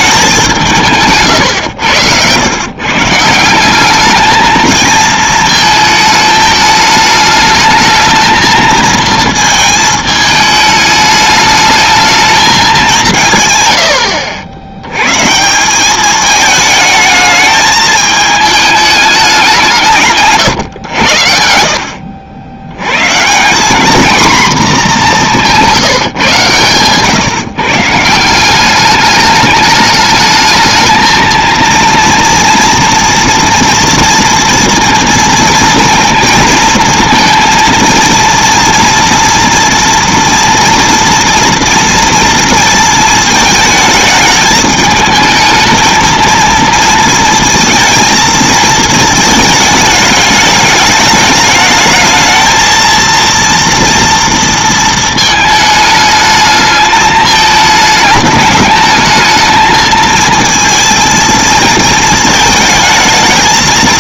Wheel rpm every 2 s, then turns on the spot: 180, 120, 220, 210, 220, 210, 210, 80, 220, 210, 130, 90, 230, 130, 190, 220, 230, 230, 230, 230, 240, 230, 210, 230, 230, 210, 220, 230, 210, 210, 230, 220.
none